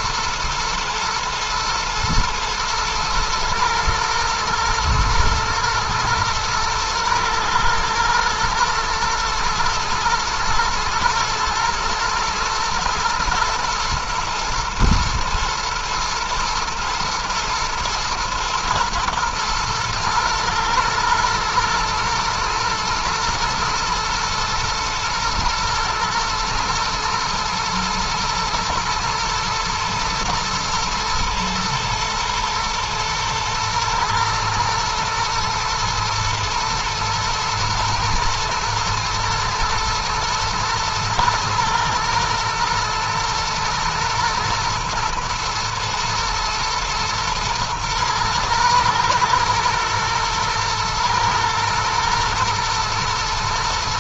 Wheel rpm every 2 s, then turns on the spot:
110, 110, 110, 110, 120, 110, 120, 110, 110, 120, 110, 110, 110, 110, 110, 110, 110, 120, 120, 110, 110, 110, 110, 120, 120, 120, 110.
none